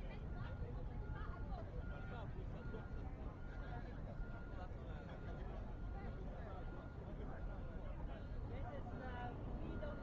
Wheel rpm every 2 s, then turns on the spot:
0, 0, 0, 0, 0.
none